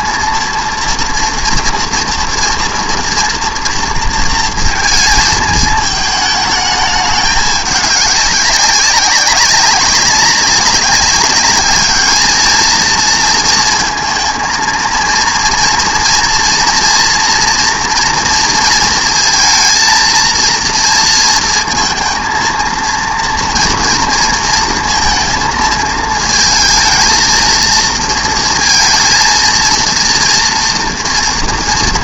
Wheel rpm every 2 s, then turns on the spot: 230, 230, 230, 210, 190, 190, 220, 220, 230, 230, 230, 230, 230, 220, 230, 230.
none